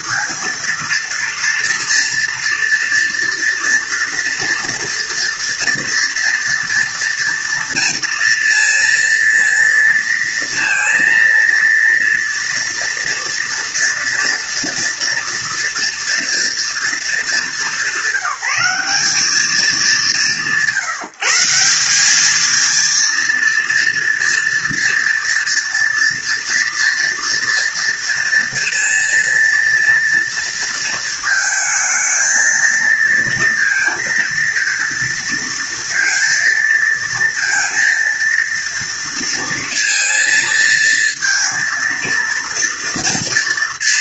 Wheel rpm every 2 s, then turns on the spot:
230, 230, 230, 230, 230, 230, 230, 230, 230, 190, 180, 220, 230, 240, 240, 230, 230, 230, 230, 230, 230, 230.
none